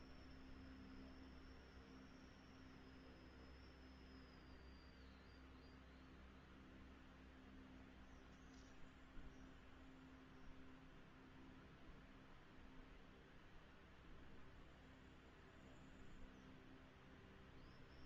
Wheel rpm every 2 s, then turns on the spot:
0, 0, 0, 0, 0, 0, 0, 0, 0.
none